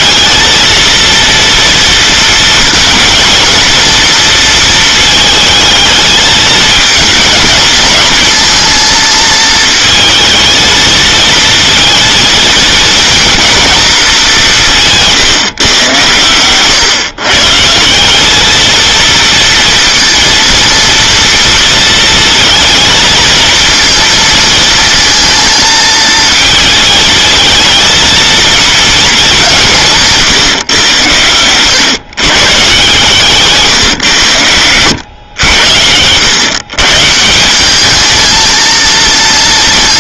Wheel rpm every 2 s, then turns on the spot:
230, 220, 230, 220, 230, 220, 230, 170, 130, 220, 230, 230, 230, 220, 230, 140, 140, 110, 130, 230.
34-36